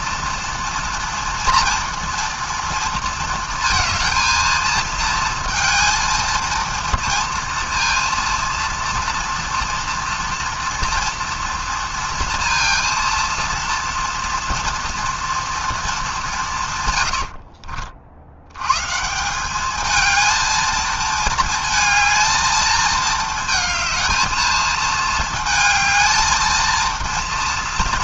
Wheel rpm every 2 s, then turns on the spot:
230, 230, 230, 230, 230, 230, 230, 230, 140, 130, 220, 220, 220, 230.
none